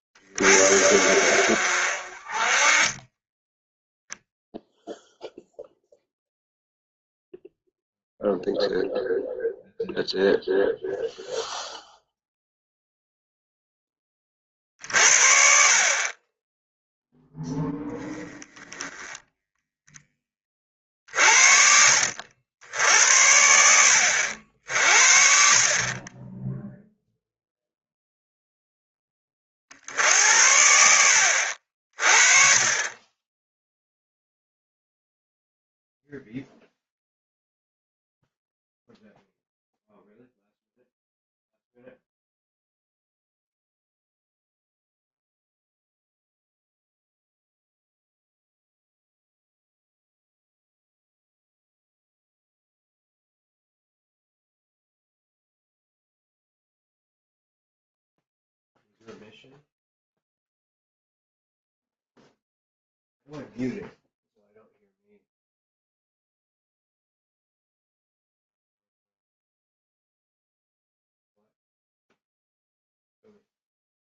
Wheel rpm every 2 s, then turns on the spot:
60, 30, 0, 0, 0, 0, 0, 50, 0, 10, 40, 80, 50, 0, 10, 70, 20, 0, 0, 0, 0, 0, 0, 0, 0, 0, 0, 0, 0, 0, 0, 0, 0, 0, 0, 0, 0.
2-4